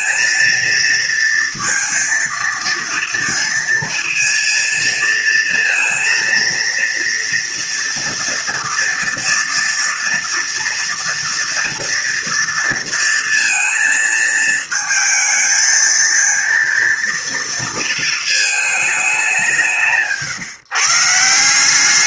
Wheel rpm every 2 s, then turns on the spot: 230, 230, 230, 230, 230, 230, 230, 220, 230, 200, 170.
none